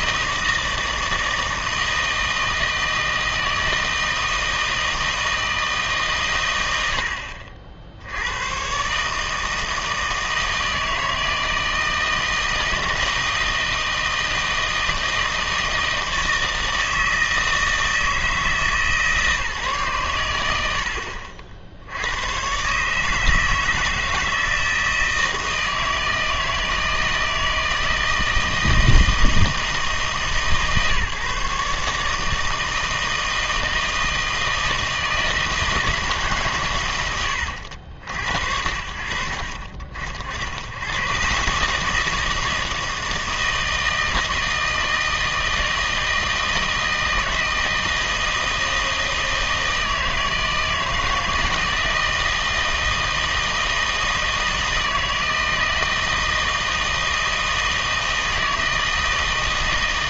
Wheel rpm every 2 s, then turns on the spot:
160, 160, 160, 100, 110, 160, 160, 160, 160, 160, 80, 130, 160, 160, 160, 150, 160, 160, 130, 70, 90, 160, 160, 160, 160, 160, 160, 160, 160, 160.
none